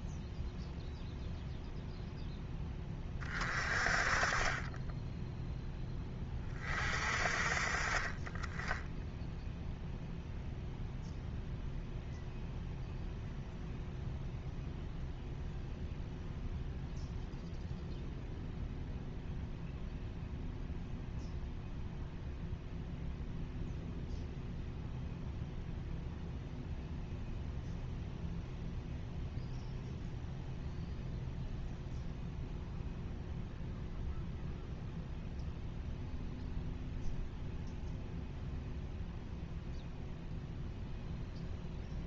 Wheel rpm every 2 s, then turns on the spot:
0, 10, 20, 30, 20, 0, 0, 0, 0, 0, 0, 0, 0, 0, 0, 0, 0, 0, 0, 0, 0.
none